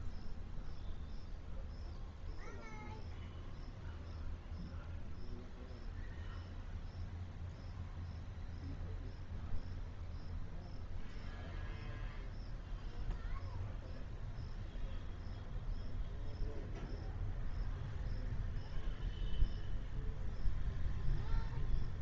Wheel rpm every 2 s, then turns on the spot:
0, 0, 0, 0, 0, 0, 0, 0, 0, 0, 0.
none